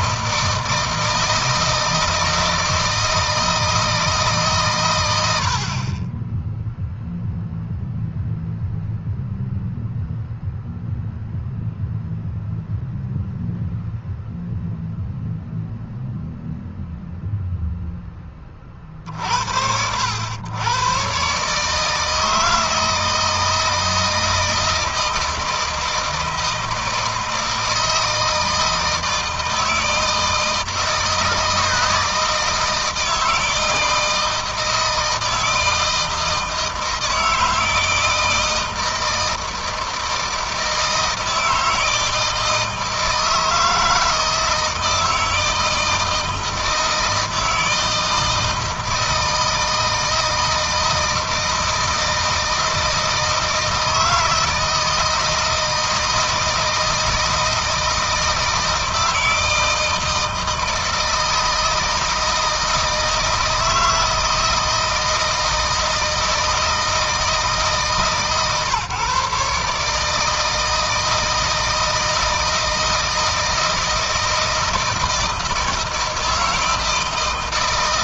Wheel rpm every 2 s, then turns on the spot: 160, 160, 120, 0, 0, 0, 0, 0, 0, 50, 130, 160, 160, 160, 160, 160, 160, 160, 160, 160, 160, 160, 160, 160, 160, 160, 160, 160, 160, 160, 160, 160, 160, 160, 140, 160, 160, 170, 160.
none